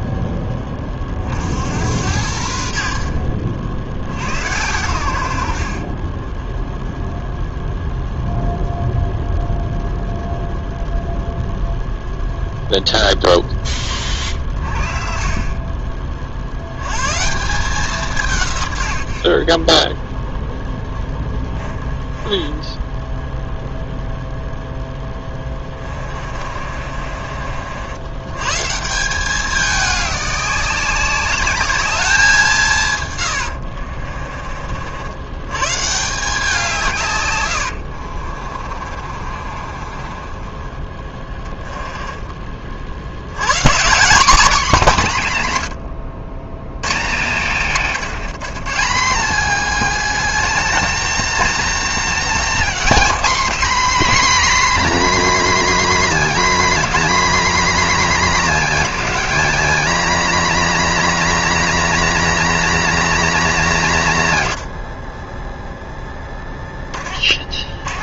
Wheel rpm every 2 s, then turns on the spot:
20, 60, 90, 0, 0, 0, 0, 30, 80, 120, 10, 10, 0, 40, 140, 190, 170, 50, 160, 40, 20, 40, 240, 120, 190, 290, 270, 310, 280, 260, 260, 300, 120, 20.
22-24 26-28 38-42